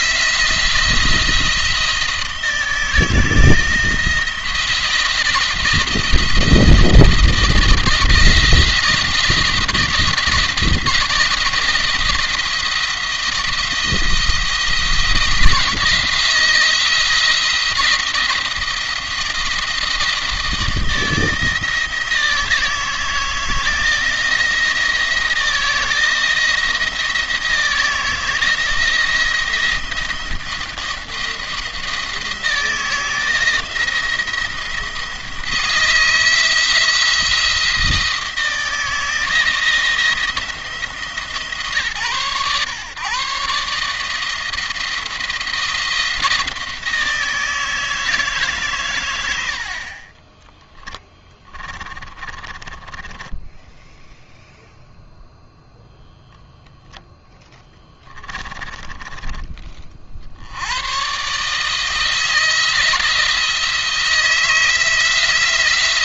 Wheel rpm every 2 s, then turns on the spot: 170, 160, 170, 170, 170, 160, 160, 160, 170, 170, 160, 160, 160, 170, 170, 170, 160, 170, 170, 160, 160, 130, 170, 160, 140, 10, 20, 0, 0, 20, 100, 170, 160.
50-54 58-60